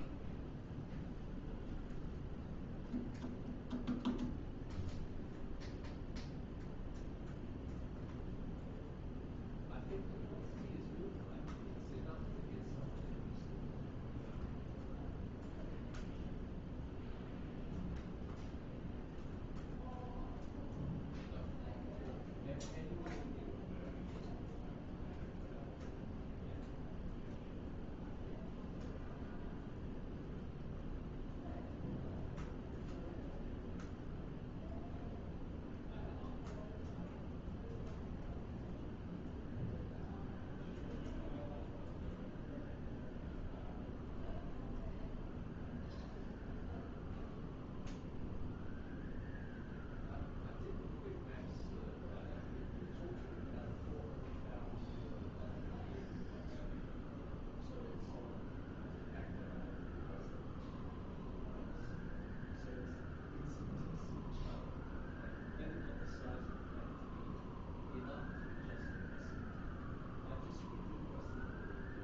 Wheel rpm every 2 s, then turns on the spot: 0, 0, 0, 0, 0, 0, 0, 0, 0, 0, 0, 0, 0, 0, 0, 0, 0, 0, 0, 0, 0, 0, 0, 0, 0, 0, 0, 0, 0, 0, 0, 0, 0, 0, 0, 0.
none